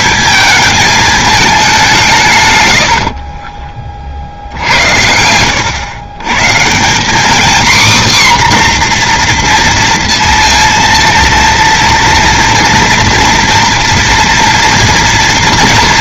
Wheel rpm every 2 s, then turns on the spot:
220, 110, 80, 160, 260, 230, 230, 230.
2-4